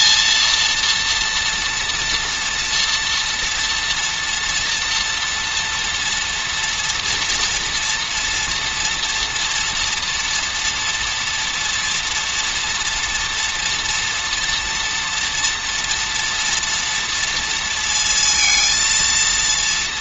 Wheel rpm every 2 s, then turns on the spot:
230, 240, 230, 230, 240, 230, 230, 240, 230, 230.
none